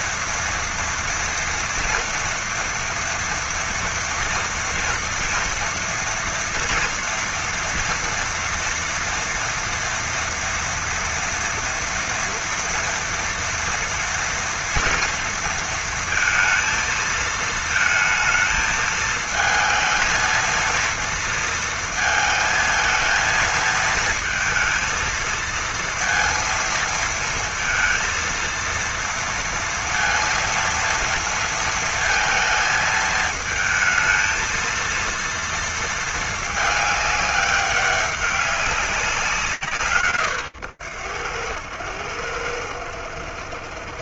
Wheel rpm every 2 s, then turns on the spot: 240, 230, 230, 230, 230, 230, 230, 230, 230, 220, 230, 220, 230, 230, 230, 230, 220, 230, 210, 190, 100, 80.
none